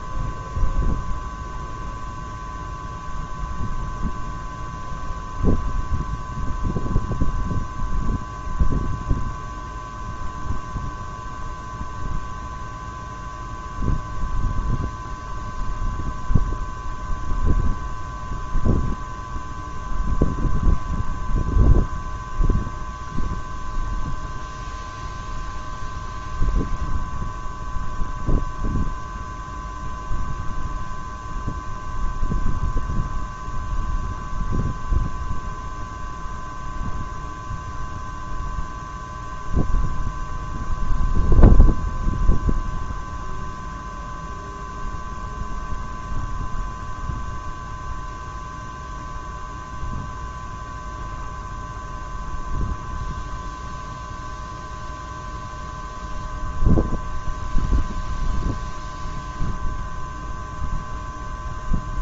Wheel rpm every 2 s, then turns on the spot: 0, 0, 0, 0, 0, 0, 0, 0, 0, 0, 0, 0, 0, 0, 0, 0, 0, 0, 0, 0, 0, 0, 0, 0, 0, 0, 0, 0, 0, 0, 0.
none